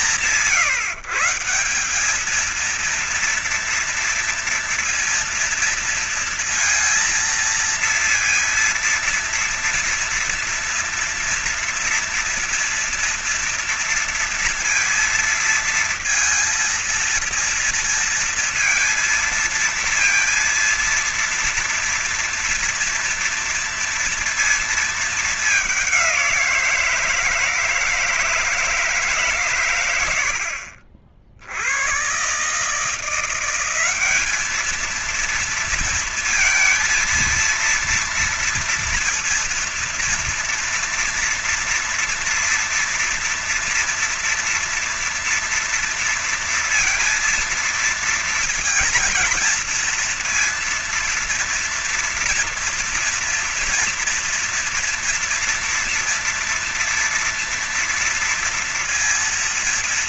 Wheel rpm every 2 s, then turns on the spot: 160, 220, 230, 230, 230, 240, 230, 230, 230, 230, 230, 230, 230, 180, 160, 70, 140, 210, 230, 230, 240, 240, 230, 230, 230, 230, 230, 230, 230, 230.
none